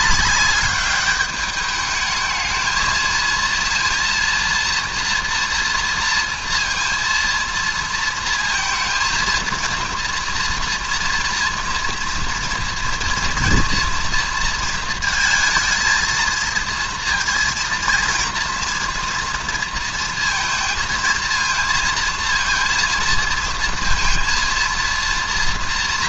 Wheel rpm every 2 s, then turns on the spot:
200, 220, 230, 230, 230, 230, 230, 230, 230, 230, 220, 230, 230.
none